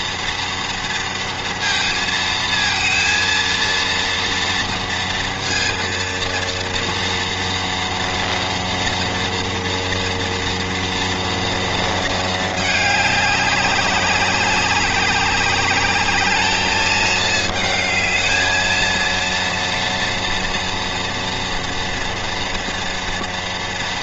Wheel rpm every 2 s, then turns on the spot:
230, 230, 230, 230, 230, 230, 220, 200, 220, 230, 230, 230.
none